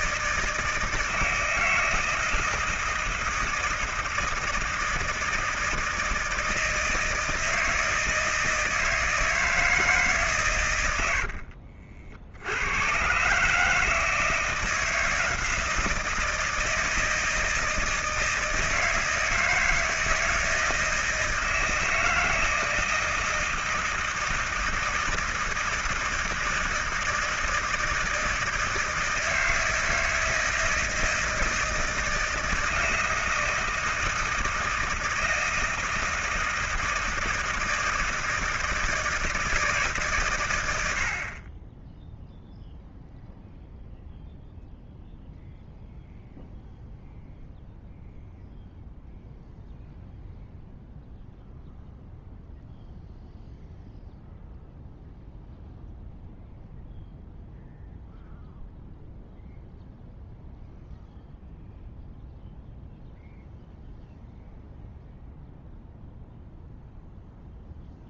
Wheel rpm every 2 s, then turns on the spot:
160, 160, 160, 160, 160, 90, 110, 170, 160, 160, 160, 160, 160, 160, 160, 160, 160, 160, 160, 160, 100, 0, 0, 0, 0, 0, 0, 0, 0, 0, 0, 0, 0, 0.
none